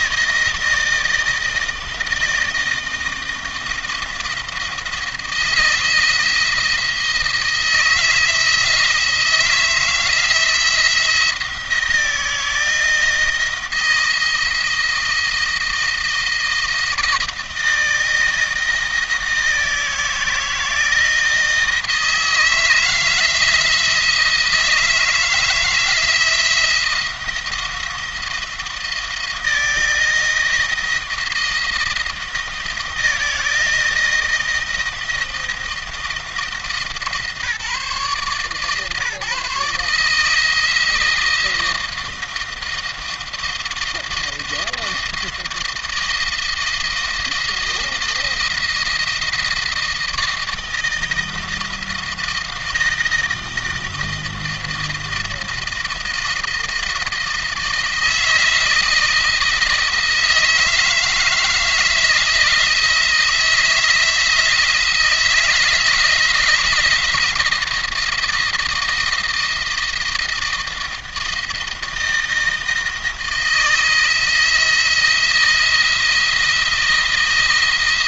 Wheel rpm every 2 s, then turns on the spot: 160, 160, 160, 170, 160, 160, 160, 170, 160, 160, 160, 160, 160, 170, 170, 160, 160, 160, 160, 150, 160, 160, 160, 170, 170, 160, 160, 170, 160, 160, 160, 160, 160, 160, 160, 160, 160, 170, 170.
none